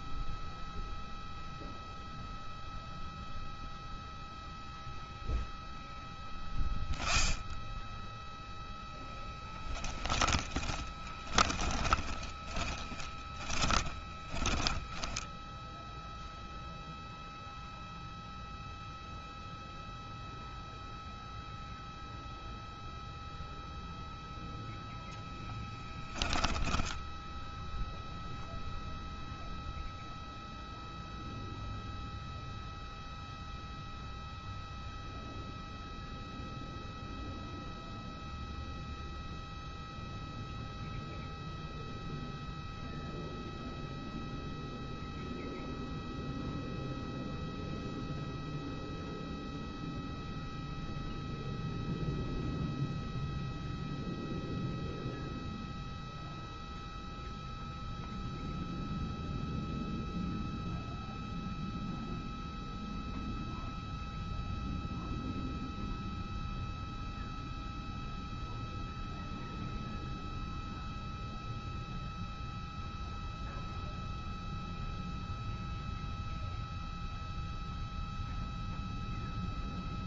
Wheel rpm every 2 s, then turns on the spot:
0, 0, 0, 10, 10, 30, 10, 10, 0, 0, 0, 0, 0, 10, 0, 0, 0, 0, 0, 0, 0, 0, 0, 0, 0, 0, 0, 0, 0, 0, 0, 0, 0, 0, 0, 0, 0, 0, 0, 0.
10-16 26-28